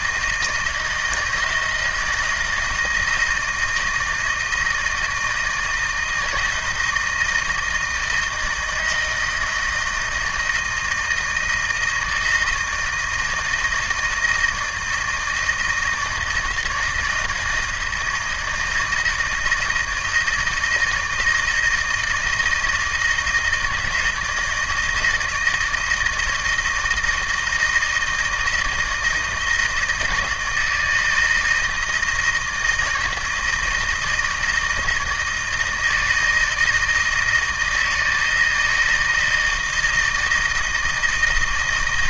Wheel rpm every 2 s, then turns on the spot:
160, 160, 160, 160, 160, 160, 160, 160, 160, 160, 160, 160, 160, 160, 170, 160, 160, 160, 160, 160, 160.
none